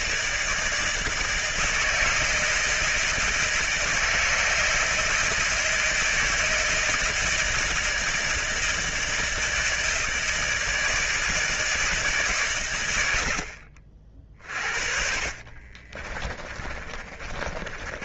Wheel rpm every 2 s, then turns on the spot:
160, 160, 160, 160, 160, 160, 130, 40, 20.
16-18